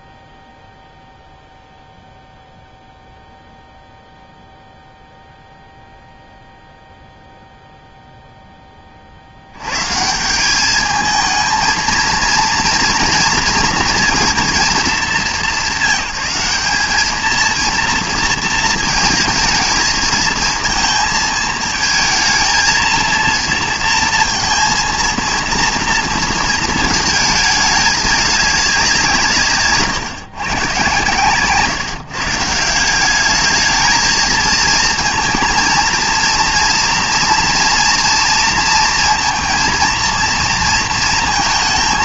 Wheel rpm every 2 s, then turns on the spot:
0, 0, 0, 0, 20, 200, 240, 220, 190, 220, 220, 230, 230, 220, 200, 130, 170, 230, 230, 230, 230.
none